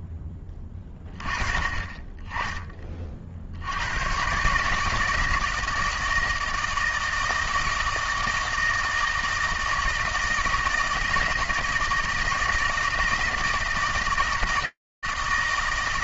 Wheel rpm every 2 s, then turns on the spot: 10, 70, 160, 160, 160, 160, 160, 160.
none